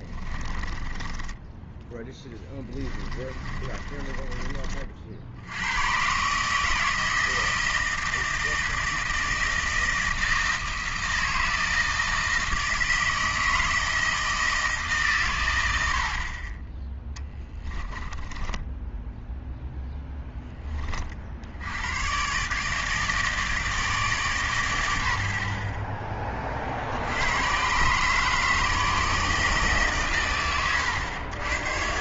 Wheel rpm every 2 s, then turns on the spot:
20, 10, 40, 150, 160, 160, 160, 160, 20, 10, 20, 150, 120, 50, 150, 110.
0-4 18-20